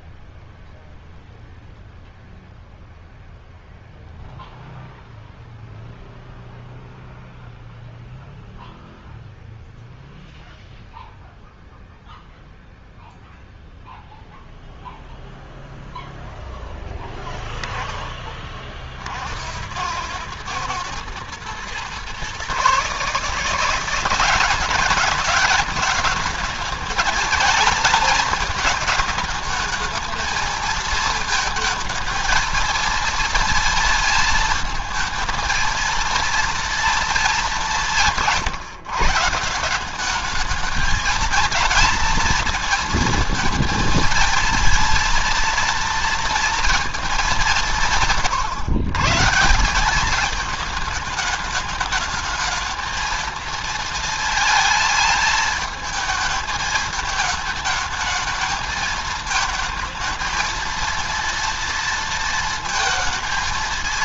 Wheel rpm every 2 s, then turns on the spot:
0, 0, 0, 0, 0, 0, 0, 0, 0, 40, 110, 140, 190, 220, 220, 220, 230, 230, 230, 150, 220, 230, 230, 230, 120, 210, 220, 220, 220, 220, 230, 230.
none